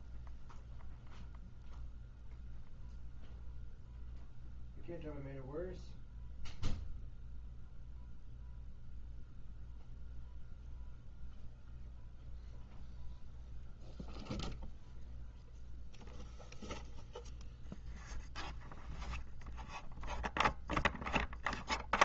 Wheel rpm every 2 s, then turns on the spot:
0, 0, 0, 0, 0, 0, 0, 0, 0, 0, 0.
none